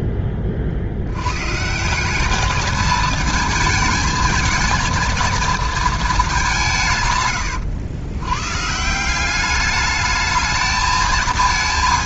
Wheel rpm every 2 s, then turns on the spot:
50, 220, 220, 160, 140, 220.
none